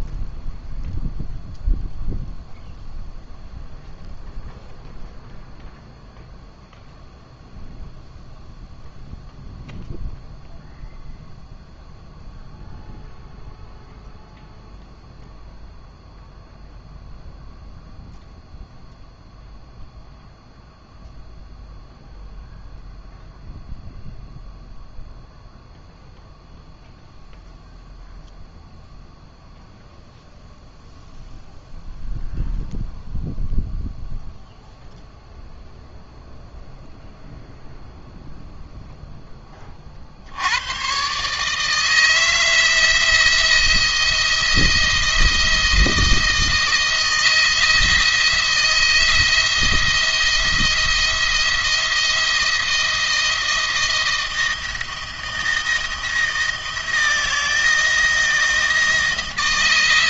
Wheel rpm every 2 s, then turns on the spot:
0, 0, 0, 0, 0, 0, 0, 0, 0, 0, 0, 0, 0, 0, 0, 0, 0, 0, 0, 0, 110, 170, 170, 160, 170, 170, 160, 160, 170, 170.
none